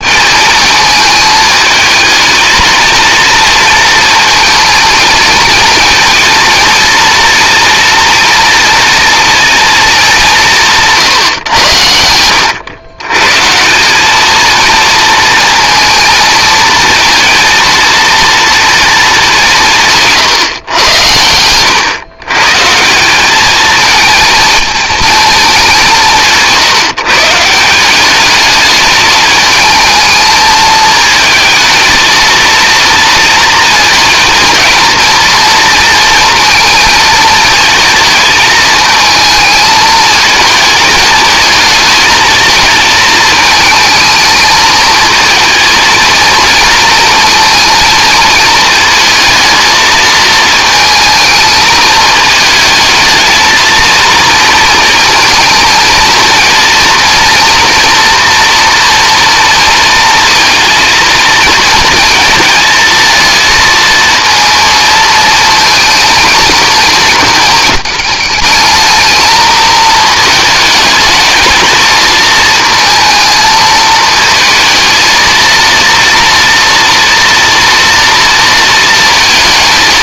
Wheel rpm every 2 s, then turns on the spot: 220, 230, 230, 230, 230, 160, 110, 230, 220, 230, 110, 150, 220, 160, 210, 220, 230, 230, 230, 220, 220, 220, 220, 230, 220, 220, 220, 230, 230, 240, 230, 230, 230, 220, 220, 220, 220, 220, 230, 230.
none